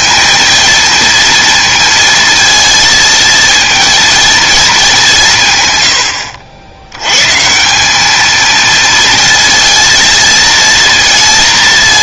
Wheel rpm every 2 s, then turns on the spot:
230, 230, 210, 90, 230, 230.
none